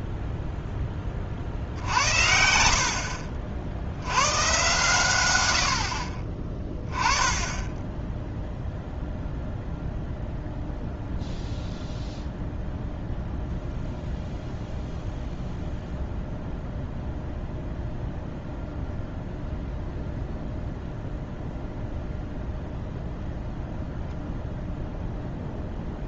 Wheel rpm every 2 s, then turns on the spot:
0, 60, 100, 20, 0, 0, 0, 0, 0, 0, 0, 0, 0.
none